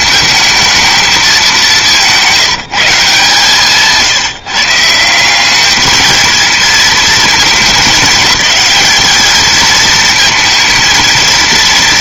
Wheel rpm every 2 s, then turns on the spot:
220, 180, 160, 220, 210, 220.
none